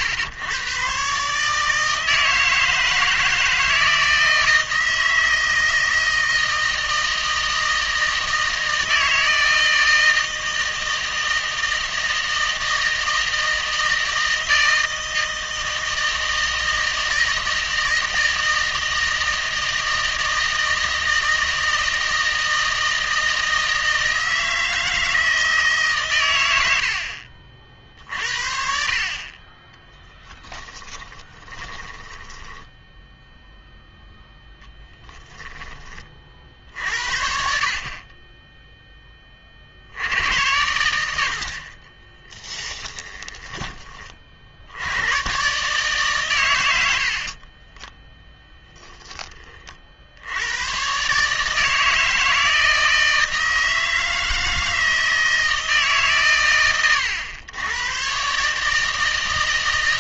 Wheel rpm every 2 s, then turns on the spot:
120, 160, 160, 160, 160, 160, 160, 160, 160, 160, 160, 160, 160, 70, 50, 10, 10, 10, 60, 10, 90, 10, 80, 90, 10, 120, 160, 160, 120, 160.
28-36 42-44